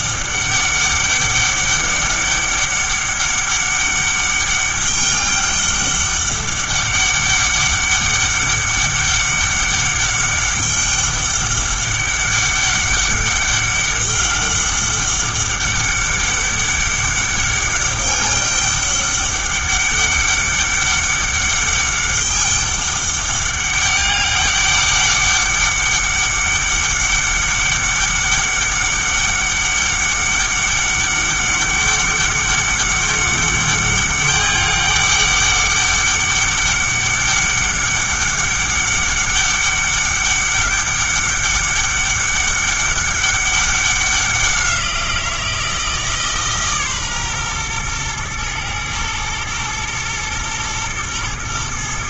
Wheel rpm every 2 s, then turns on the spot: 200, 200, 200, 200, 200, 200, 200, 200, 200, 200, 200, 200, 200, 200, 200, 200, 200, 200, 200, 200, 200, 200, 180, 150, 110, 110.
none